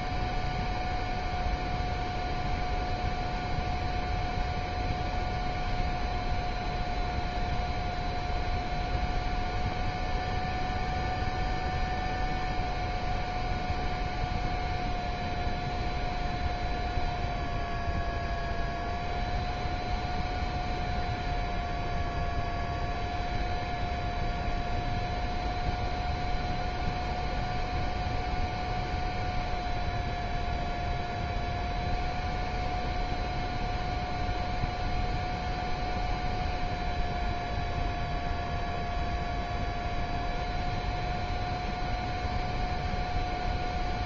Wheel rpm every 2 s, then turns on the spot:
0, 0, 0, 0, 0, 0, 0, 0, 0, 0, 0, 0, 0, 0, 0, 0, 0, 0, 0, 0, 0, 0.
none